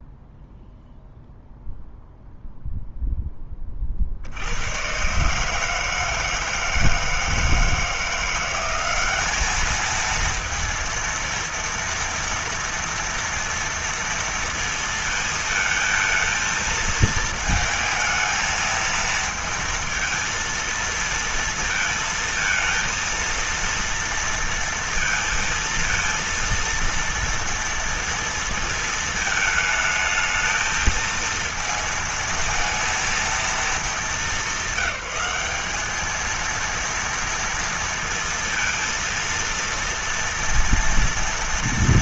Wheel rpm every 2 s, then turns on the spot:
0, 0, 100, 160, 190, 230, 230, 230, 220, 220, 230, 230, 230, 230, 230, 220, 230, 210, 230, 230, 230.
none